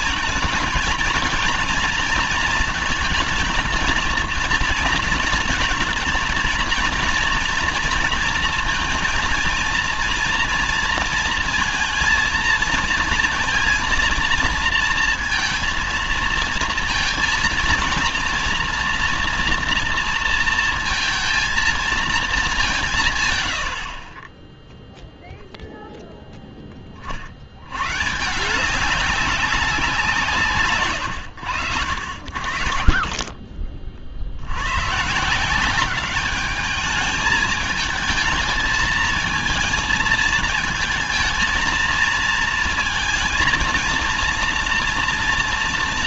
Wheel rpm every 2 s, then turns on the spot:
230, 230, 220, 230, 230, 230, 230, 230, 230, 240, 230, 180, 0, 20, 190, 140, 40, 110, 210, 220, 220, 230, 230.
none